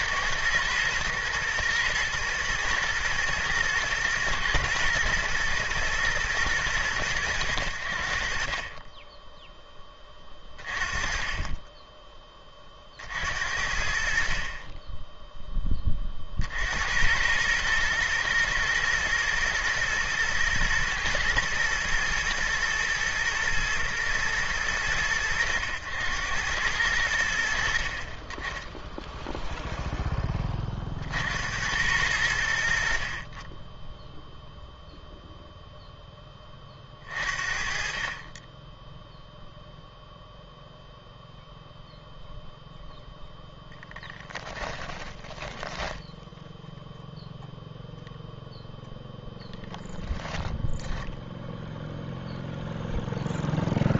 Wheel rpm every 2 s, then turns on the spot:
120, 120, 120, 100, 30, 30, 40, 20, 80, 110, 120, 120, 100, 70, 10, 40, 60, 0, 30, 10, 0, 0, 10, 0, 0, 10, 0.
44-46